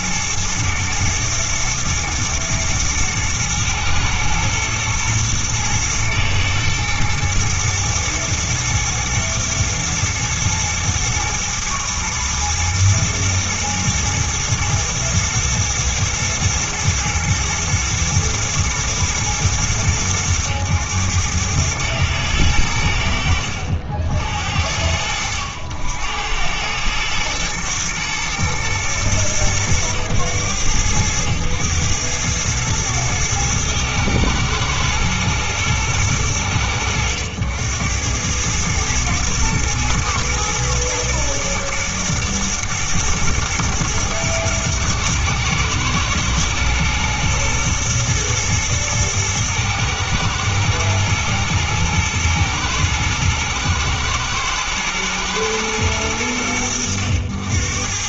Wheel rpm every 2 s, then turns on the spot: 120, 120, 110, 110, 120, 120, 120, 110, 120, 110, 100, 70, 70, 110, 110, 100, 110, 110, 80, 110, 120, 110, 110, 110, 110, 110, 110, 120, 90.
none